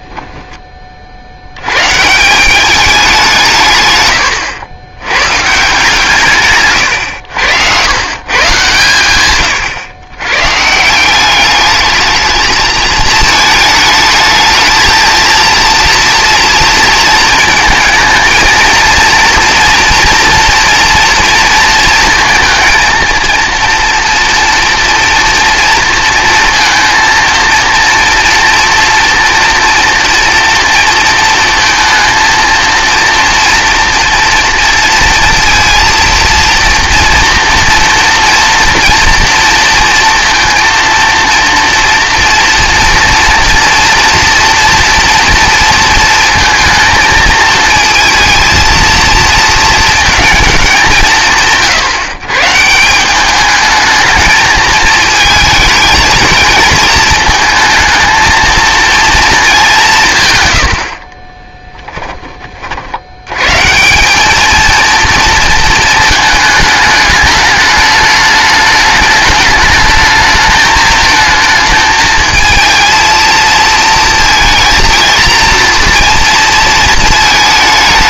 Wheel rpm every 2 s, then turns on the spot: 20, 190, 80, 130, 120, 140, 220, 220, 230, 230, 230, 230, 230, 230, 240, 240, 230, 230, 230, 230, 230, 230, 230, 230, 230, 180, 150, 220, 220, 220, 100, 40, 220, 220, 210, 220, 220, 230, 230.
none